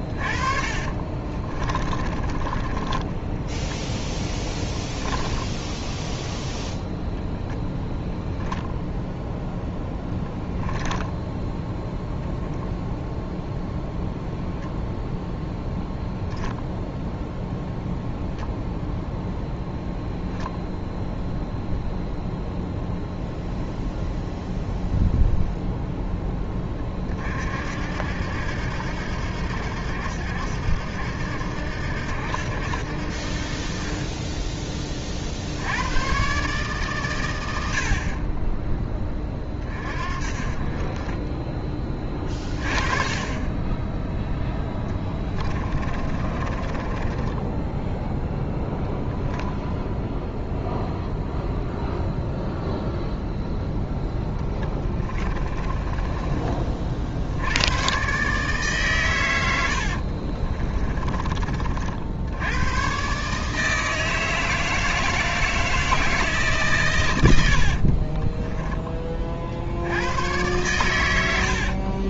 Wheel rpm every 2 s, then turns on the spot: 30, 10, 0, 0, 0, 10, 0, 0, 0, 0, 0, 0, 0, 30, 80, 80, 70, 20, 130, 20, 30, 30, 10, 20, 0, 0, 0, 20, 40, 130, 30, 110, 160, 120, 20, 110.
0-4 10-12 44-48 54-56 60-62